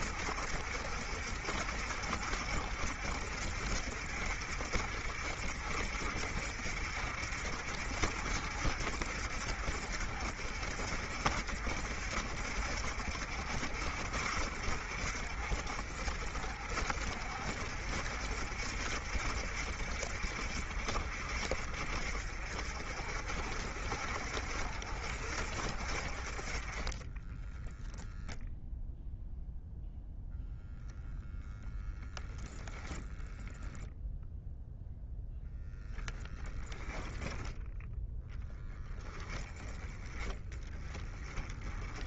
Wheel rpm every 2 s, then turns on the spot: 60, 60, 60, 60, 60, 60, 60, 60, 60, 60, 50, 50, 50, 20, 0, 0, 0, 0, 0, 10, 20.
26-28